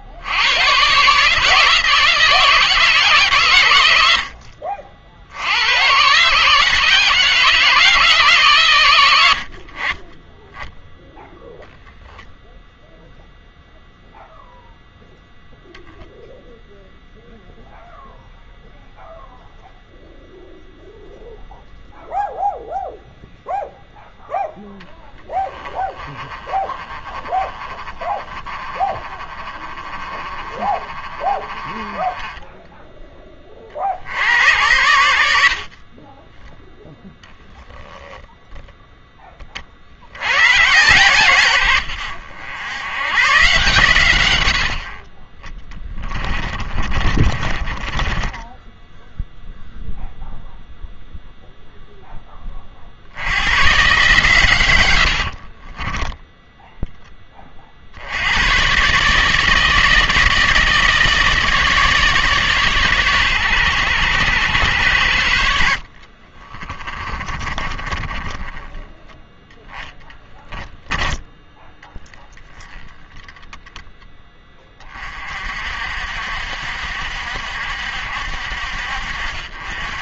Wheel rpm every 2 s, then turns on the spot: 110, 160, 50, 150, 130, 10, 0, 0, 0, 0, 0, 0, 10, 20, 20, 20, 10, 90, 0, 0, 120, 90, 70, 30, 10, 0, 30, 110, 0, 110, 160, 140, 100, 30, 10, 10, 10, 20, 60, 60.
26-28 46-48 66-70